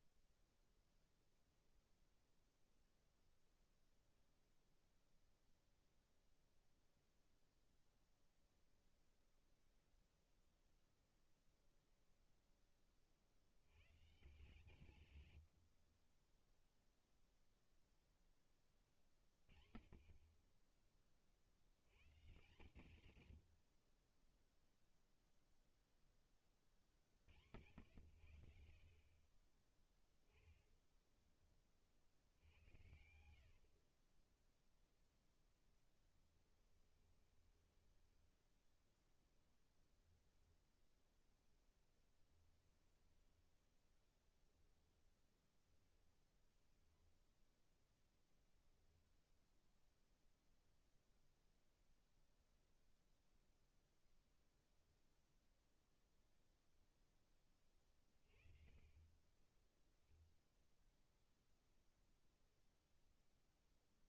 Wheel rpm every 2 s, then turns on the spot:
0, 0, 0, 0, 0, 0, 50, 140, 0, 50, 40, 130, 0, 70, 40, 10, 90, 0, 30, 10, 0, 10, 10, 0, 0, 0, 0, 0, 20, 20, 0, 0.
32-34 36-38 56-58